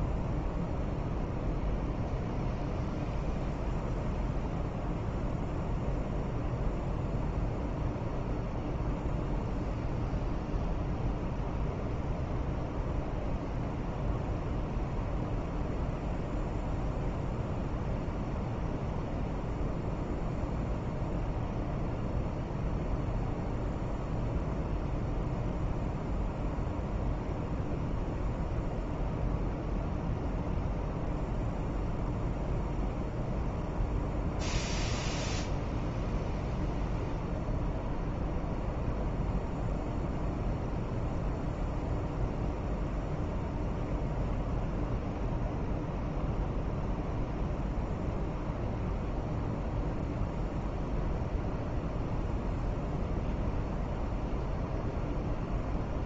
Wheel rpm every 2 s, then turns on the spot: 0, 0, 0, 0, 0, 0, 0, 0, 0, 0, 0, 0, 0, 0, 0, 0, 0, 0, 0, 0, 0, 0, 0, 0, 0, 0, 0, 0.
none